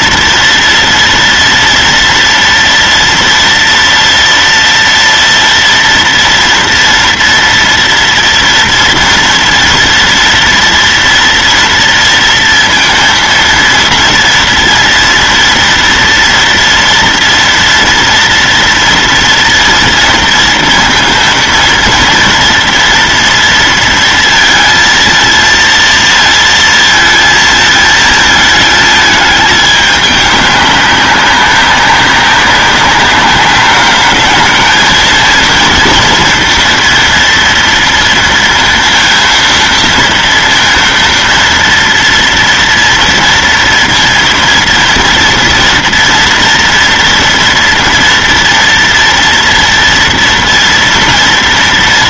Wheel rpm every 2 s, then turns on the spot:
230, 230, 230, 230, 230, 230, 230, 230, 240, 230, 230, 230, 230, 230, 220, 200, 200, 220, 230, 230, 230, 230, 230, 230, 230, 240.
none